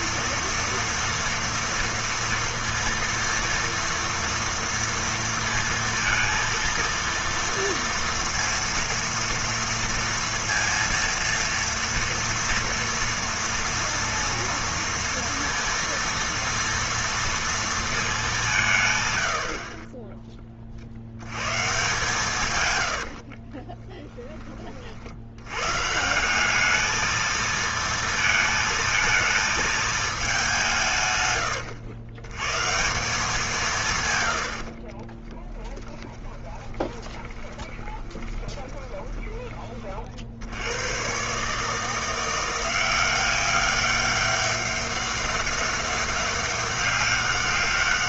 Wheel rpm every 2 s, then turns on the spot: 230, 230, 230, 230, 230, 230, 230, 230, 230, 190, 30, 160, 10, 190, 230, 200, 110, 90, 20, 20, 70, 170, 200, 200.
36-40